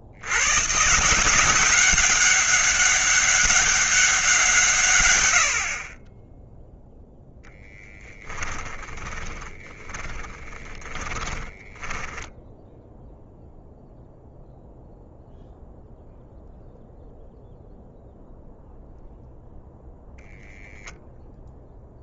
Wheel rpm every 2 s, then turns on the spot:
140, 200, 140, 0, 20, 20, 0, 0, 0, 0, 0.
8-12